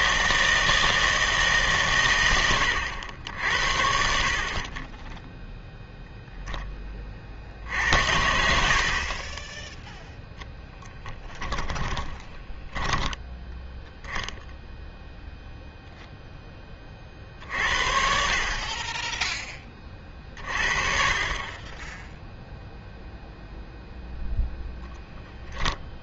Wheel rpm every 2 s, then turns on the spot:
160, 100, 30, 10, 60, 10, 10, 0, 20, 30, 40, 0, 0.
10-14